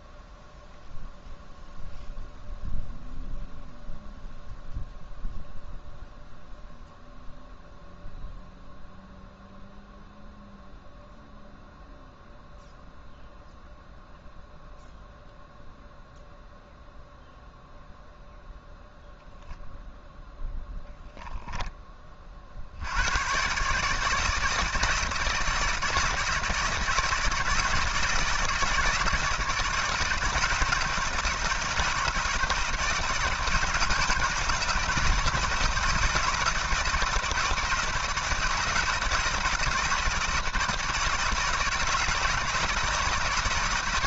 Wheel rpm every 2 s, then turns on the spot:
0, 0, 0, 0, 0, 0, 0, 0, 0, 0, 0, 70, 160, 160, 160, 160, 160, 160, 160, 160, 160, 160.
none